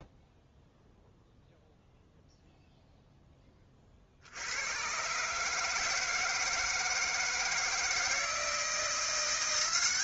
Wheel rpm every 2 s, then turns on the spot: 0, 0, 80, 160, 160.
none